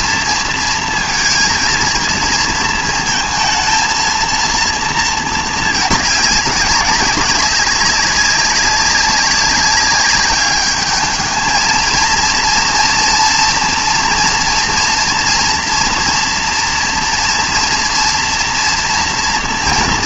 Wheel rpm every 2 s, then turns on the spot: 230, 230, 230, 200, 190, 210, 230, 230, 230, 240.
none